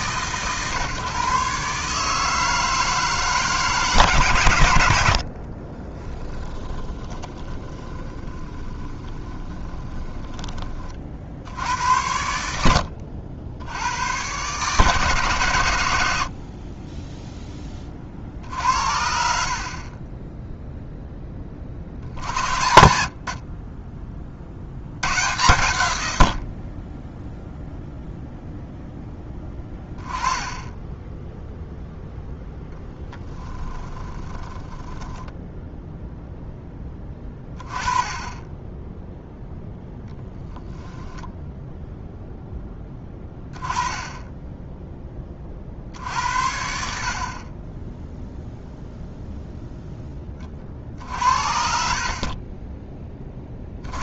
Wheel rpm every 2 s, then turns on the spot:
130, 160, 100, 10, 20, 30, 70, 130, 40, 60, 0, 70, 70, 50, 0, 10, 0, 20, 0, 10, 0, 0, 10, 60, 0, 30, 30.
6-10 30-32 34-36